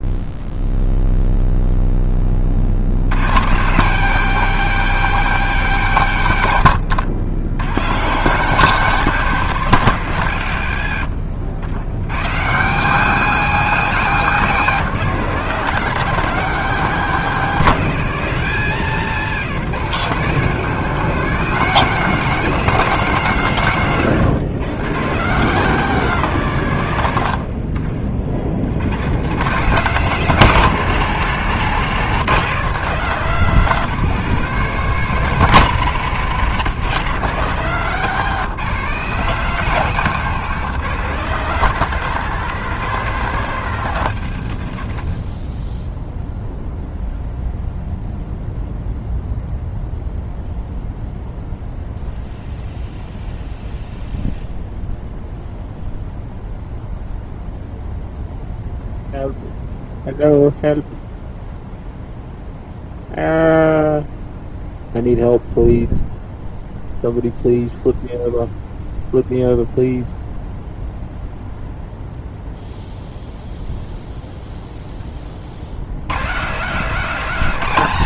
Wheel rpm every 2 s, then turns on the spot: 0, 110, 210, 100, 170, 80, 200, 180, 180, 150, 160, 190, 170, 110, 130, 150, 180, 190, 170, 180, 160, 170, 30, 0, 0, 0, 0, 0, 0, 0, 0, 0, 0, 0, 0, 0, 0, 30, 260.
10-12